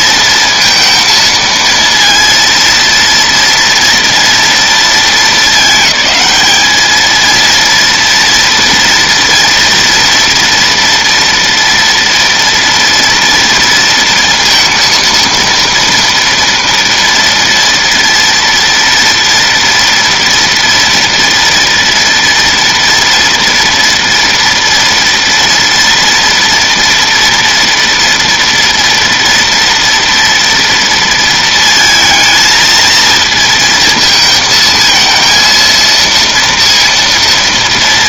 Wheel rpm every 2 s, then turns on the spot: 230, 230, 220, 220, 240, 230, 230, 230, 230, 230, 230, 230, 230, 230, 230, 230, 230, 230, 230.
none